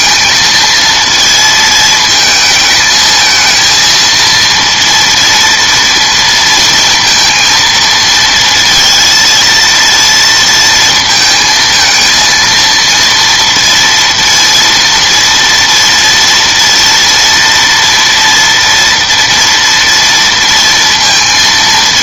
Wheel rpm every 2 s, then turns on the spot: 220, 220, 230, 230, 230, 230, 230, 230, 230, 230, 230.
none